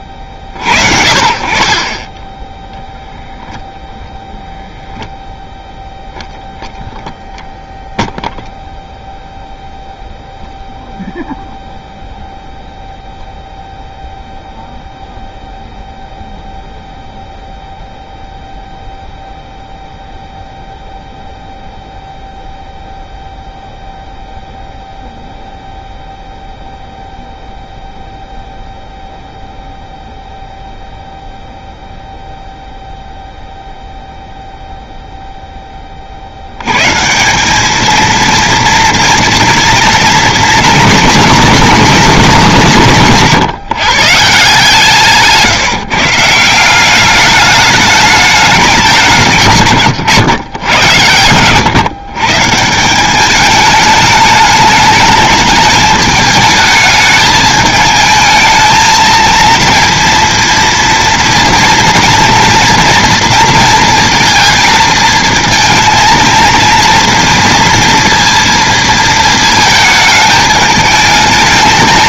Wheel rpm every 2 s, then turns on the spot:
50, 10, 0, 10, 0, 0, 0, 0, 0, 0, 0, 0, 0, 0, 0, 0, 0, 0, 130, 230, 230, 180, 170, 180, 190, 110, 180, 210, 220, 230, 230, 230, 230, 230, 230, 220.
none